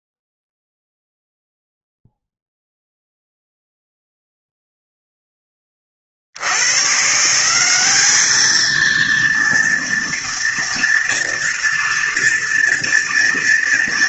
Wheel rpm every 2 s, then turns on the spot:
0, 0, 0, 80, 210, 230, 230.
none